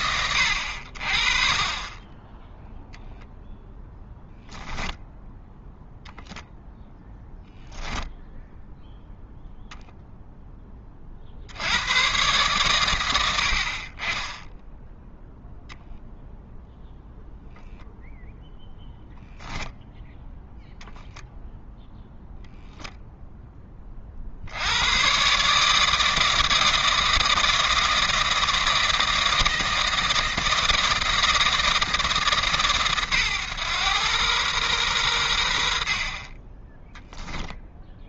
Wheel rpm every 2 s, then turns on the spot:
70, 0, 0, 0, 0, 20, 110, 10, 0, 0, 0, 0, 90, 160, 160, 160, 140, 110, 10.
none